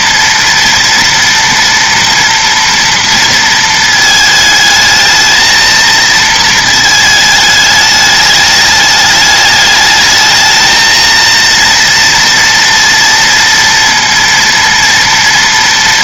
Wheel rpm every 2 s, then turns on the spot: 230, 240, 220, 220, 210, 220, 230, 230.
none